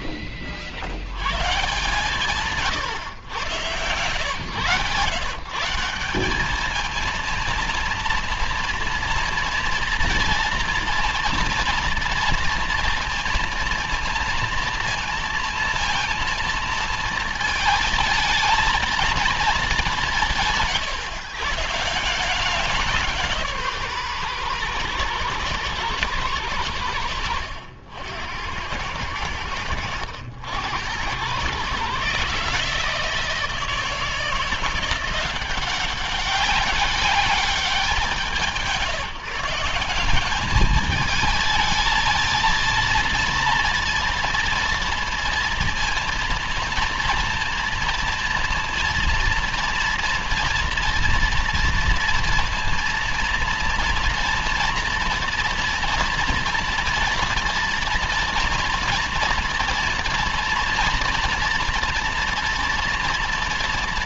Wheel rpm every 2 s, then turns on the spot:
90, 100, 130, 230, 230, 230, 230, 230, 230, 230, 130, 170, 120, 90, 90, 100, 160, 180, 200, 160, 220, 230, 230, 230, 230, 230, 230, 230, 230, 230, 230, 230.
none